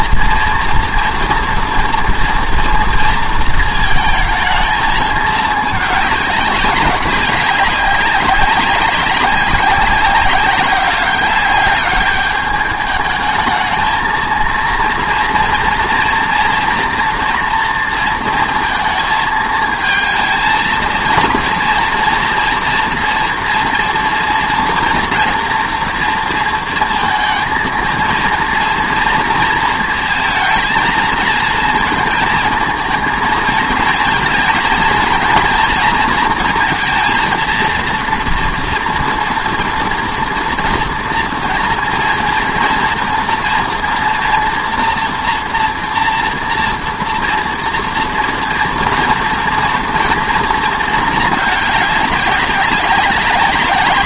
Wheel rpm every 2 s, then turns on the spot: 230, 230, 220, 200, 190, 200, 210, 230, 240, 230, 220, 230, 230, 230, 230, 230, 220, 230, 230, 240, 230, 230, 230, 230, 230, 230, 190.
none